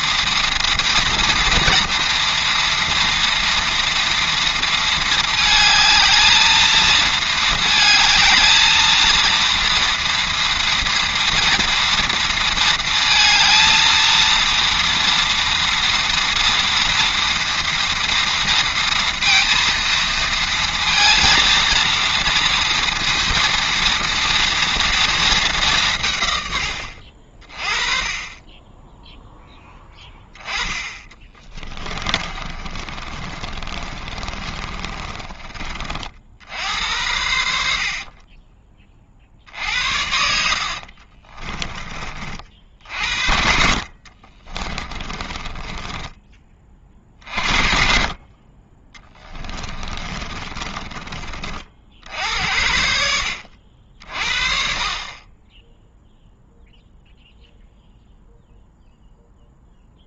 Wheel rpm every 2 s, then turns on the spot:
230, 230, 220, 220, 230, 230, 230, 230, 230, 230, 230, 230, 230, 70, 10, 20, 40, 20, 80, 40, 50, 60, 20, 50, 20, 30, 70, 40, 0, 0.
30-36 40-42 44-46